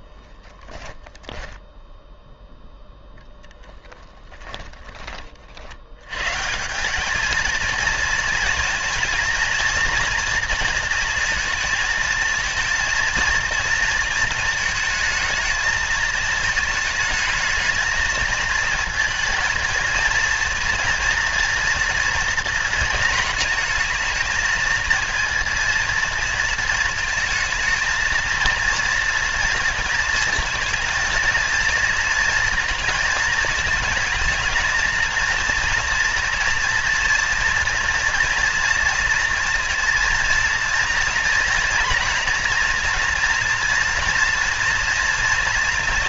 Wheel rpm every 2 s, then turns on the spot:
10, 0, 20, 170, 230, 230, 230, 220, 220, 220, 230, 230, 230, 220, 230, 220, 230, 220, 240, 230, 230, 230, 230.
none